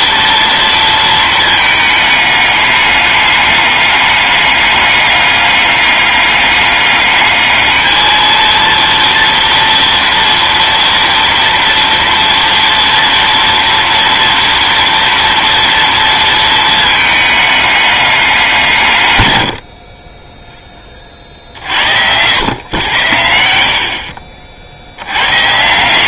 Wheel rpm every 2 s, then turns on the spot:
230, 210, 200, 200, 230, 230, 230, 230, 230, 180, 20, 100, 60.
none